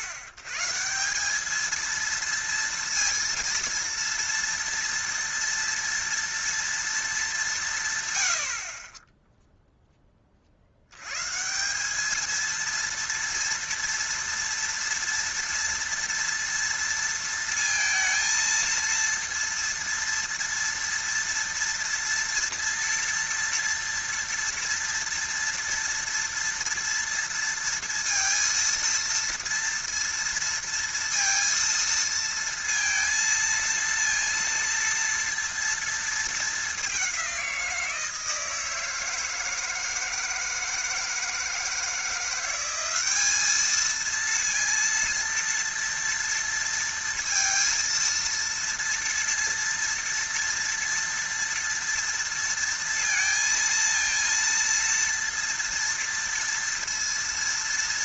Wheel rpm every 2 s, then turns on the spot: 120, 230, 230, 230, 50, 60, 230, 230, 230, 230, 230, 230, 230, 230, 230, 230, 230, 230, 210, 160, 160, 190, 230, 230, 230, 230, 230, 230, 230.
none